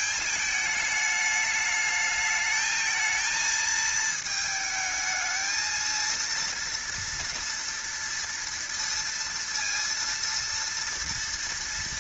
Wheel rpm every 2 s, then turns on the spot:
210, 220, 220, 230, 230, 230.
none